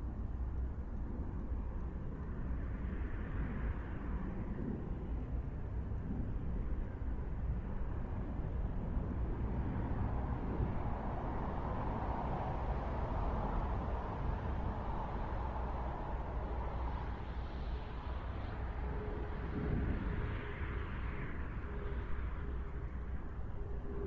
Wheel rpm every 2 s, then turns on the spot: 0, 0, 0, 0, 0, 0, 0, 0, 0, 0, 0, 0.
none